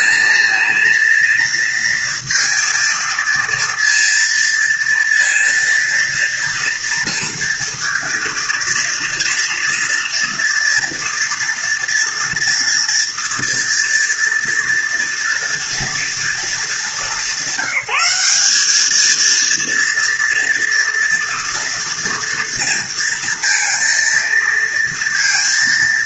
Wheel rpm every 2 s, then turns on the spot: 220, 230, 230, 230, 230, 230, 230, 230, 230, 200, 230, 230, 230.
none